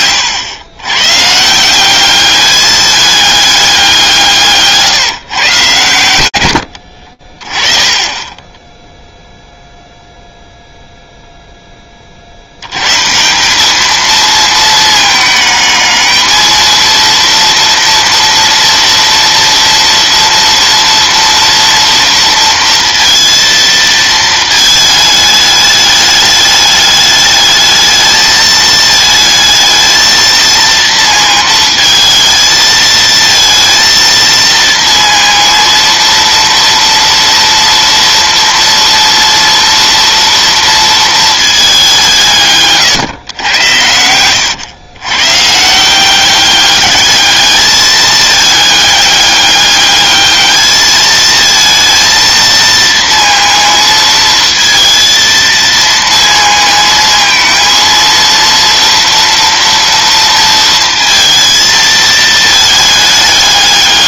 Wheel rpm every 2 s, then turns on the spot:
100, 210, 160, 70, 10, 0, 90, 220, 230, 230, 230, 230, 220, 210, 220, 230, 220, 230, 230, 230, 230, 150, 110, 200, 210, 210, 230, 230, 230, 230, 230, 220.
42-44